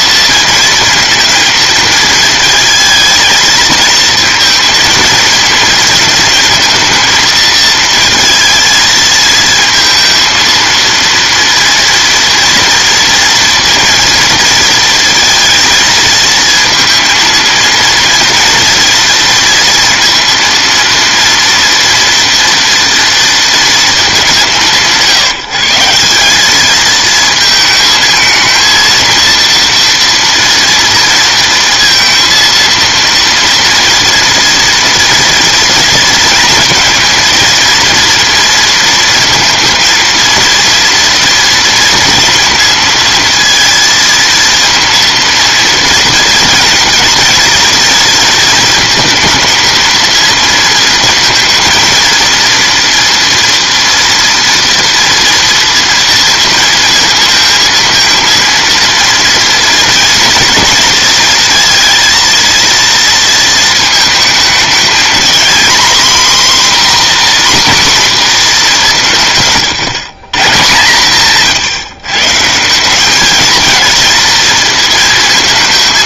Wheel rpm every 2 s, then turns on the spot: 230, 230, 230, 220, 230, 230, 230, 230, 230, 230, 230, 230, 170, 210, 220, 230, 230, 230, 230, 230, 230, 230, 230, 230, 230, 230, 230, 230, 230, 230, 230, 230, 220, 250, 210, 140, 160, 230.
none